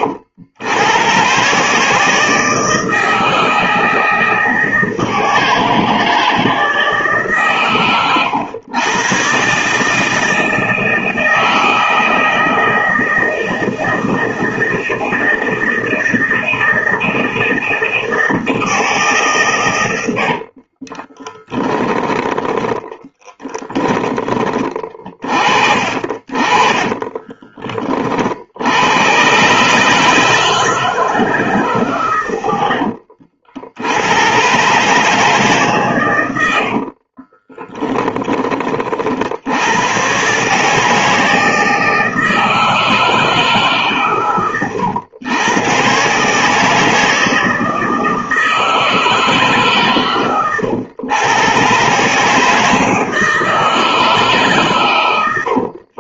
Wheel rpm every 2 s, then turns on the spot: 110, 160, 160, 150, 110, 160, 160, 160, 160, 150, 20, 10, 30, 20, 110, 160, 70, 140, 40, 50, 160, 160, 110, 160, 160, 110, 160, 120.
20-22 26-28 32-34 36-38